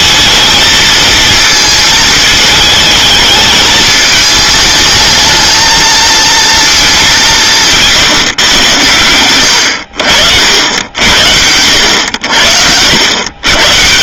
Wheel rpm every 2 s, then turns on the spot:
220, 220, 210, 220, 110, 80, 70.
none